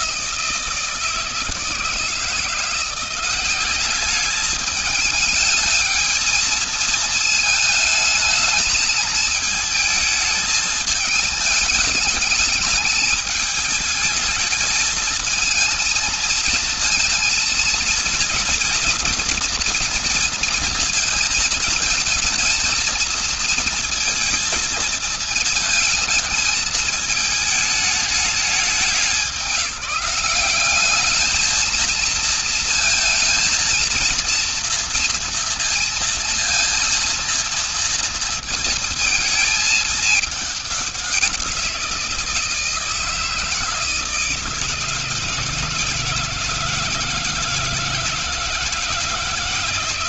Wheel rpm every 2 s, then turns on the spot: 160, 170, 210, 220, 220, 220, 210, 220, 230, 230, 220, 220, 220, 220, 210, 210, 230, 230, 230, 230, 200, 170, 160, 160, 160.
none